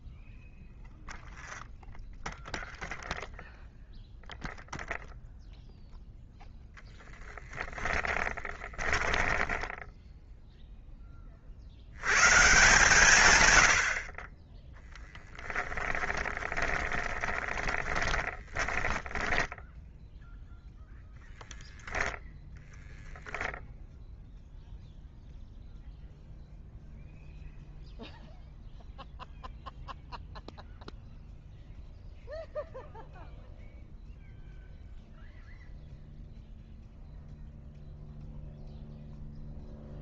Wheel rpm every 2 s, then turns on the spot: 0, 0, 0, 0, 10, 0, 130, 10, 10, 20, 0, 0, 0, 0, 0, 0, 0, 0, 0, 0.
8-10 16-20